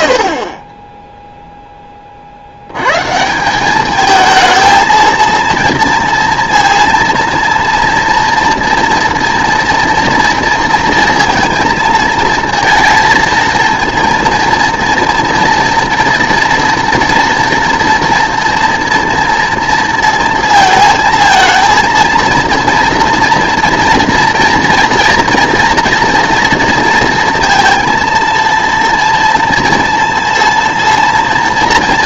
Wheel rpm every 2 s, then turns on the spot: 20, 110, 230, 230, 230, 230, 230, 230, 230, 230, 230, 230, 230, 230, 230, 230.
none